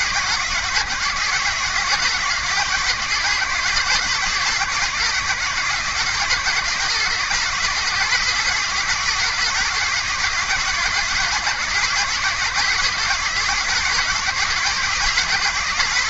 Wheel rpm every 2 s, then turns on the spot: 130, 130, 130, 140, 140, 130, 130, 130.
none